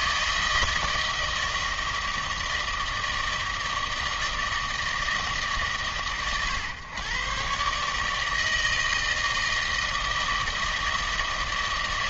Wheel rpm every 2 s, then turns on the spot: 160, 160, 160, 120, 160, 160.
none